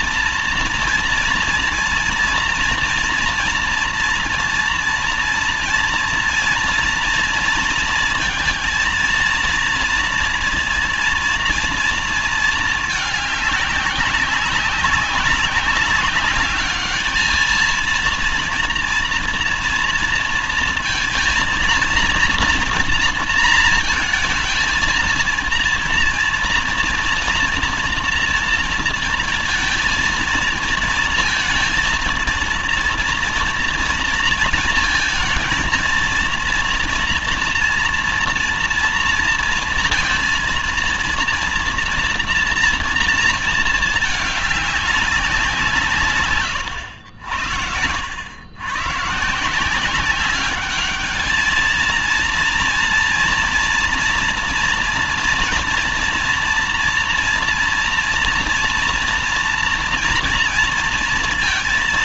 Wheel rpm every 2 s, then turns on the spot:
230, 230, 230, 230, 230, 230, 220, 200, 210, 230, 230, 230, 220, 230, 230, 230, 230, 230, 230, 230, 230, 230, 210, 110, 120, 200, 230, 240, 230, 230, 230.
none